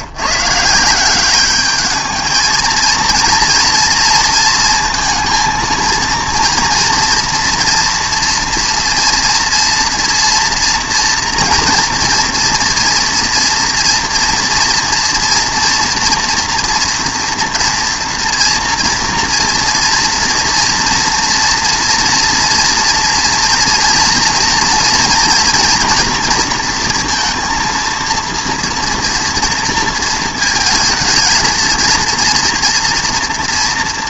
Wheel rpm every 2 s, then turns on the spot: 180, 230, 230, 230, 230, 230, 230, 230, 230, 230, 230, 230, 230, 230, 230, 220, 230.
none